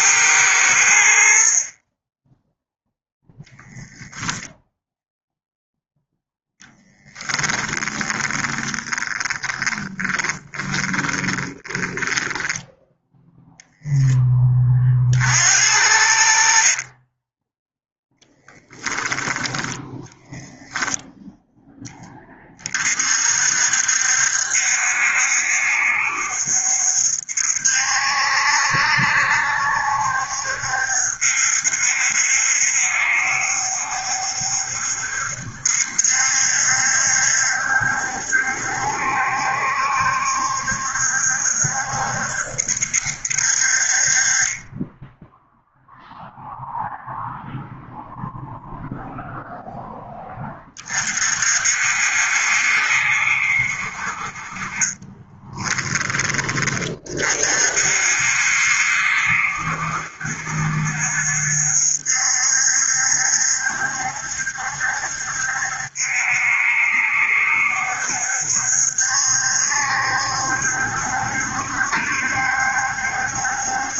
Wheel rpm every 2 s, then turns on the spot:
70, 0, 10, 10, 20, 20, 0, 50, 20, 10, 0, 40, 70, 70, 70, 70, 70, 70, 70, 70, 70, 60, 10, 0, 0, 40, 70, 30, 40, 70, 70, 70, 70, 70, 70, 70, 70.
6-12 16-18 54-56